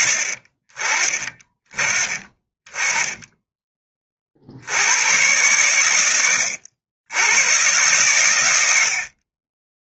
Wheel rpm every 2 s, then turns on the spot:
30, 20, 80, 80, 90.
none